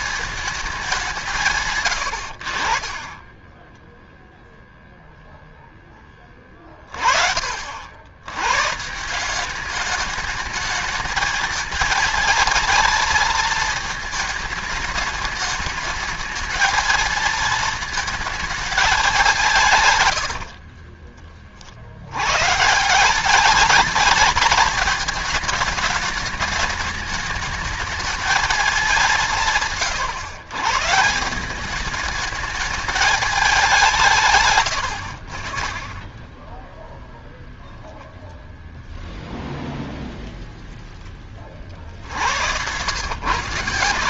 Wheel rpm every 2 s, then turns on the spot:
200, 60, 0, 20, 140, 220, 230, 210, 220, 220, 70, 150, 220, 210, 210, 140, 210, 120, 10, 0, 0, 90.
2-4 20-22 34-36